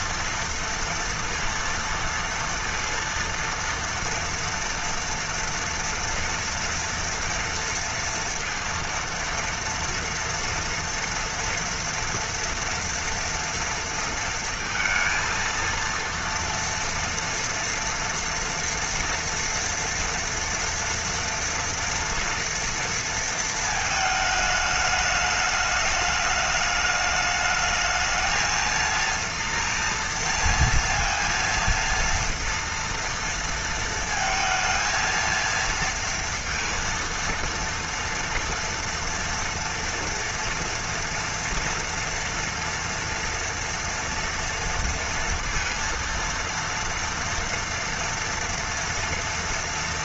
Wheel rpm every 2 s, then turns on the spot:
230, 230, 230, 230, 230, 230, 230, 230, 230, 230, 240, 230, 210, 210, 230, 230, 230, 230, 230, 230, 230, 230, 230, 230, 230.
none